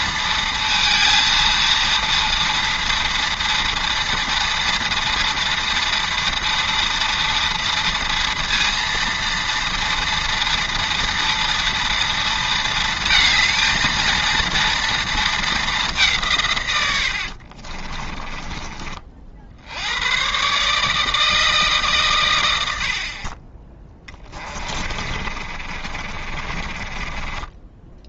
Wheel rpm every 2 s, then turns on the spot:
230, 240, 240, 230, 230, 230, 230, 230, 140, 20, 130, 100, 30, 40.
24-28